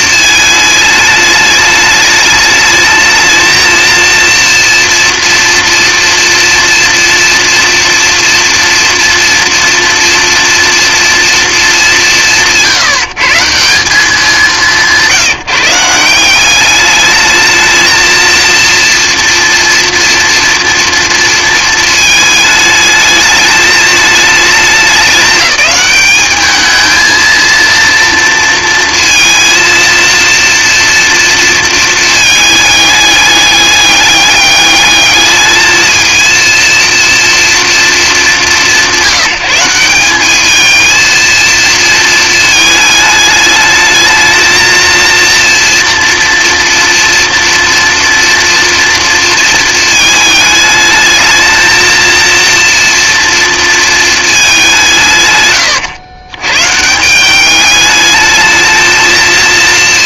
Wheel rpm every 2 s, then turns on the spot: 220, 210, 230, 230, 230, 230, 180, 180, 200, 230, 230, 210, 210, 220, 230, 230, 210, 210, 230, 190, 210, 220, 220, 230, 230, 220, 230, 180, 120, 220.
none